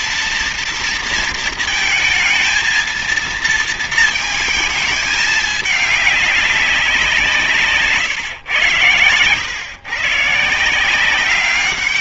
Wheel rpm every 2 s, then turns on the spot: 230, 220, 220, 190, 110, 160.
none